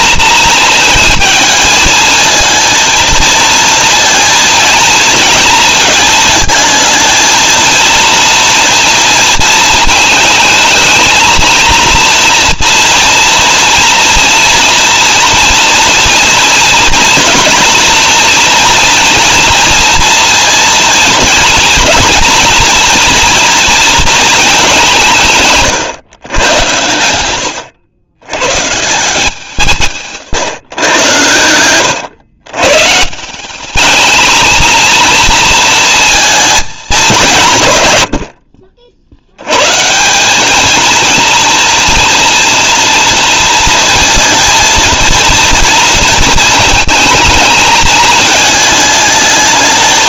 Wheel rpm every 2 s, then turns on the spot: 220, 230, 230, 220, 230, 220, 240, 240, 230, 230, 230, 230, 200, 100, 140, 120, 120, 230, 210, 50, 220, 240, 230, 220, 220.
none